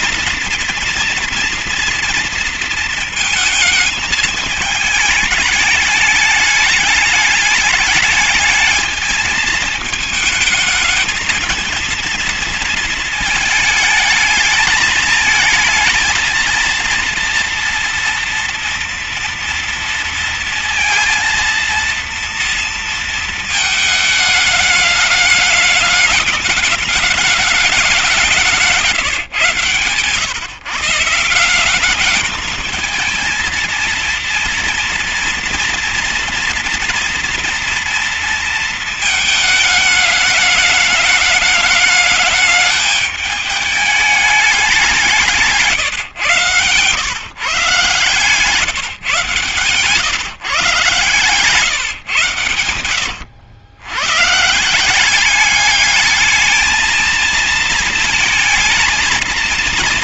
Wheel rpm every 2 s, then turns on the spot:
230, 220, 210, 210, 220, 230, 220, 220, 230, 230, 230, 220, 200, 200, 120, 180, 230, 230, 230, 220, 210, 210, 150, 130, 130, 150, 80, 200, 220, 220.
none